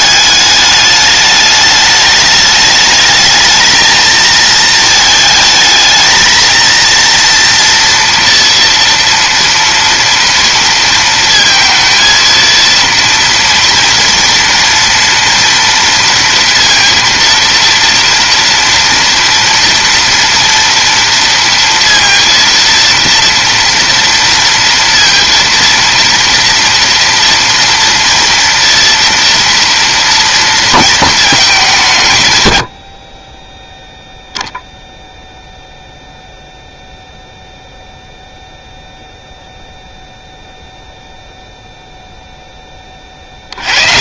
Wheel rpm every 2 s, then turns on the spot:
210, 210, 220, 230, 230, 230, 230, 230, 230, 230, 230, 230, 230, 230, 230, 230, 50, 0, 0, 0, 0, 20.
none